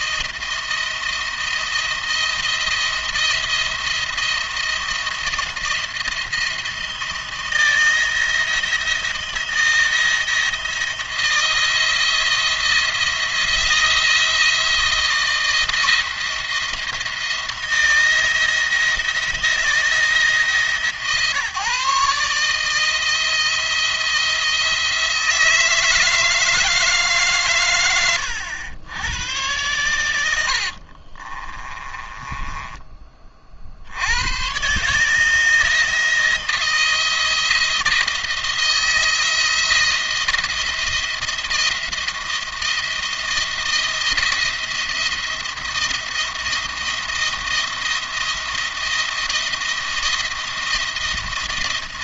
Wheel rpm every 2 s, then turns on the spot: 170, 170, 170, 170, 160, 160, 170, 160, 170, 160, 150, 160, 170, 160, 100, 70, 20, 120, 170, 170, 170, 170, 170, 170, 170, 170.
30-32